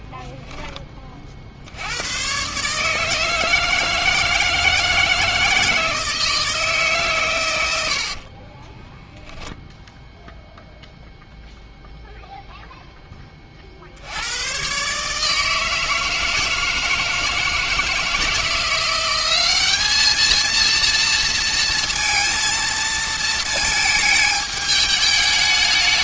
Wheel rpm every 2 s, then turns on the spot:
20, 130, 160, 160, 30, 0, 0, 110, 160, 170, 230, 230, 210.
8-10